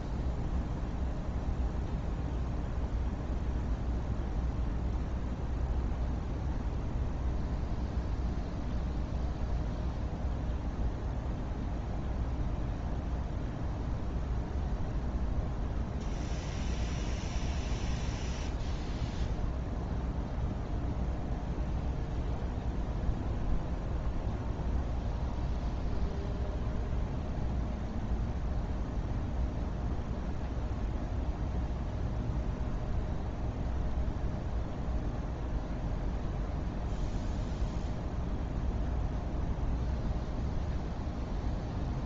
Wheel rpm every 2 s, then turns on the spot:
0, 0, 0, 0, 0, 0, 0, 0, 0, 0, 0, 0, 0, 0, 0, 0, 0, 0, 0, 0, 0.
none